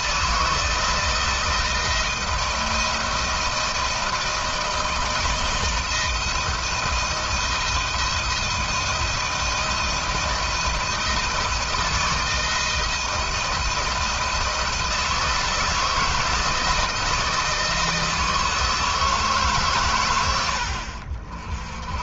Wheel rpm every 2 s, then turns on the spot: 160, 160, 160, 170, 170, 160, 160, 160, 160, 160, 70.
none